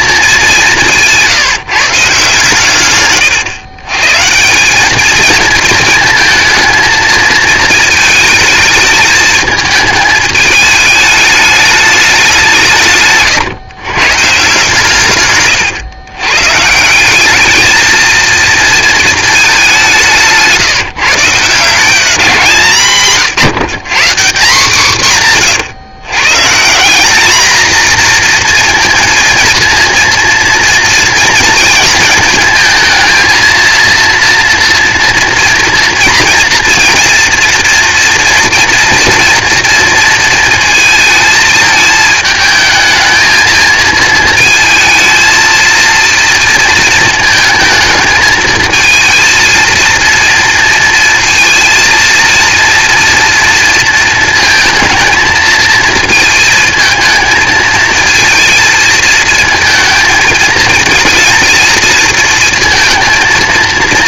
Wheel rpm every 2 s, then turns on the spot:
190, 130, 180, 230, 220, 210, 170, 140, 150, 230, 160, 160, 190, 160, 230, 230, 220, 230, 240, 240, 230, 220, 220, 230, 220, 230, 230, 220, 220, 220, 220, 230.
none